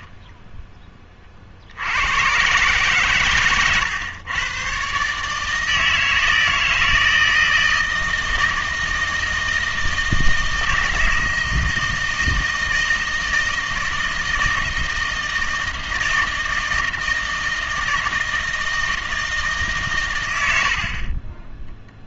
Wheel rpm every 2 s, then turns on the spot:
10, 130, 120, 160, 160, 160, 160, 160, 160, 160, 60.
none